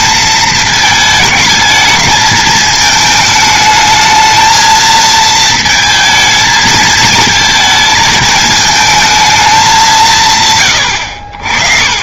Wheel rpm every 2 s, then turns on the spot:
220, 220, 220, 220, 220, 130.
none